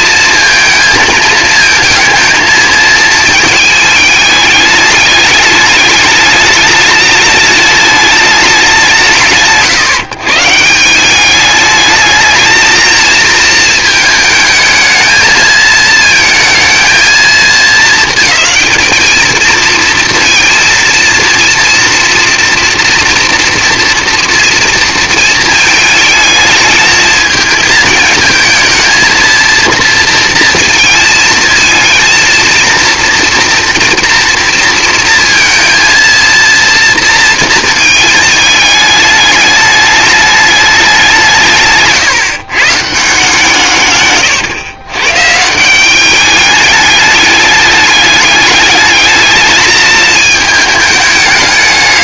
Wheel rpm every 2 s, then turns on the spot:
230, 220, 210, 210, 190, 150, 220, 220, 220, 210, 230, 230, 230, 220, 220, 230, 230, 230, 230, 210, 210, 140, 110, 210, 210, 210.
none